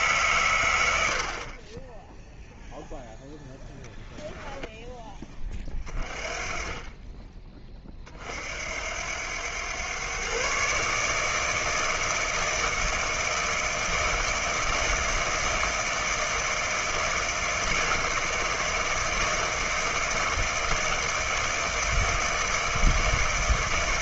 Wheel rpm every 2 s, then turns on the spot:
90, 0, 10, 30, 70, 140, 160, 160, 160, 160, 160, 160.
none